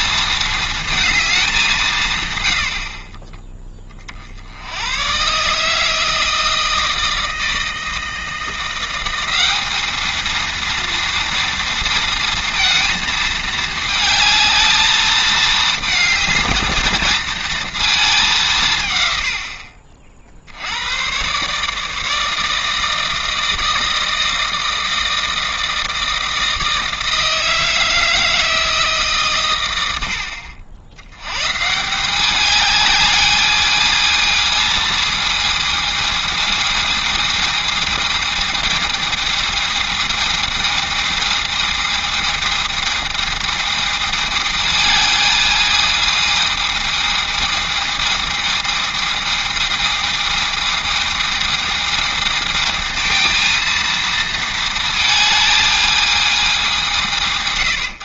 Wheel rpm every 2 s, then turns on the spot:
230, 70, 90, 160, 170, 230, 230, 220, 220, 160, 80, 160, 160, 160, 160, 70, 210, 220, 220, 220, 220, 220, 220, 220, 220, 220, 220, 220, 170.
none